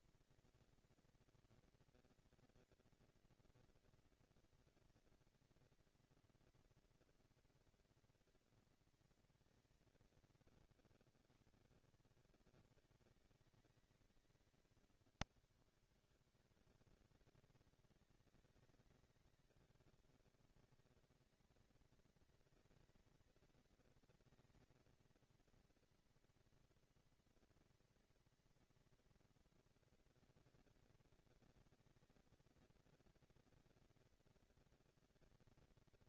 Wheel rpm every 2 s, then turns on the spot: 230, 230, 230, 240, 230, 150, 190, 210, 200, 190, 220, 230, 230, 230, 240, 240, 230, 230.
none